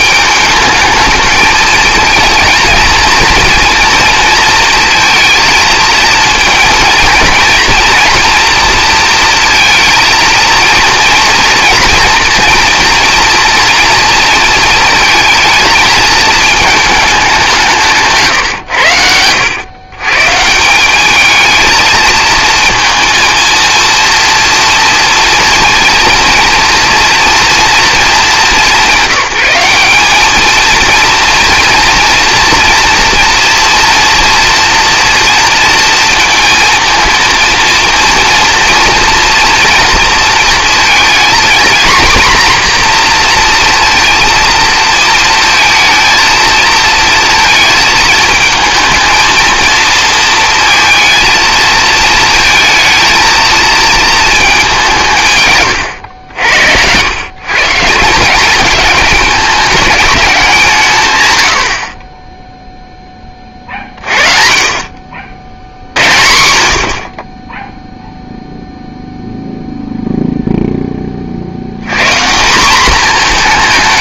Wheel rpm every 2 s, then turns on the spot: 220, 220, 220, 230, 230, 230, 240, 230, 220, 100, 170, 230, 230, 230, 200, 220, 230, 230, 220, 230, 230, 240, 230, 230, 220, 230, 230, 200, 100, 210, 170, 0, 40, 70, 0, 0, 190.
none